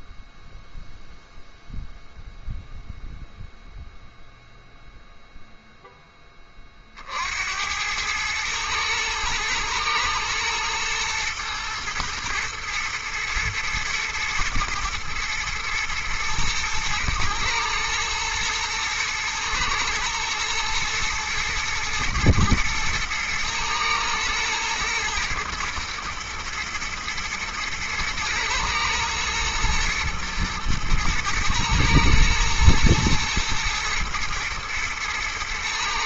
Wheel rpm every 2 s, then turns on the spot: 0, 0, 0, 20, 110, 110, 110, 110, 110, 110, 120, 120, 120, 120, 110, 110, 110, 120.
none